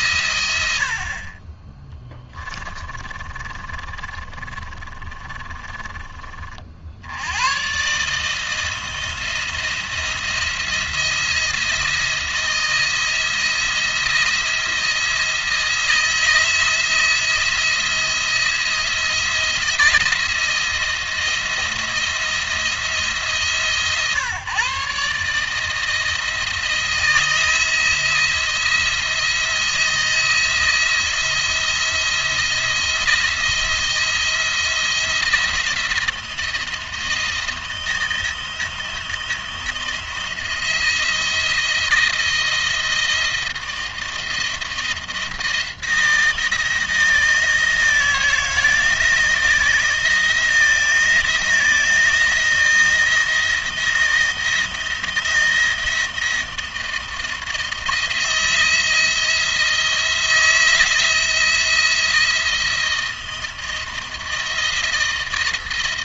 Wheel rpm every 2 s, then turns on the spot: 80, 20, 30, 60, 160, 170, 160, 170, 160, 170, 170, 160, 130, 160, 170, 170, 170, 170, 170, 170, 160, 160, 170, 160, 160, 160, 170, 170, 160, 170, 160, 170, 160.
2-6